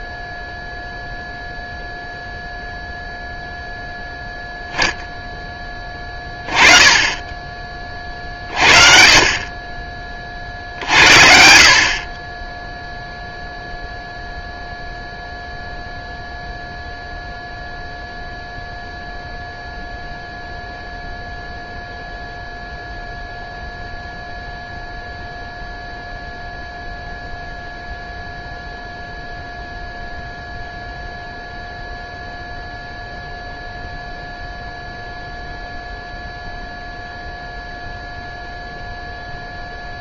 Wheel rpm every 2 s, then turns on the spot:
0, 0, 0, 20, 40, 60, 0, 0, 0, 0, 0, 0, 0, 0, 0, 0, 0, 0, 0, 0.
none